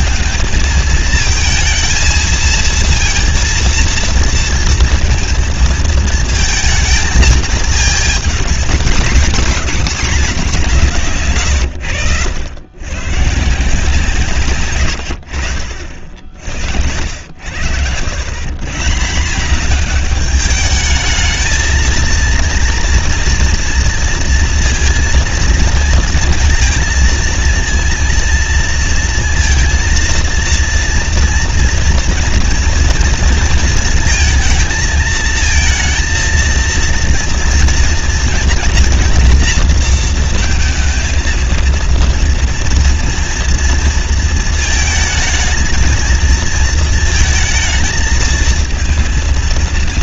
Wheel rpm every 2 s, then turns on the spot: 220, 230, 230, 220, 240, 160, 120, 90, 70, 170, 220, 230, 230, 230, 230, 230, 230, 220, 230, 230, 230, 240, 220, 230, 230.
none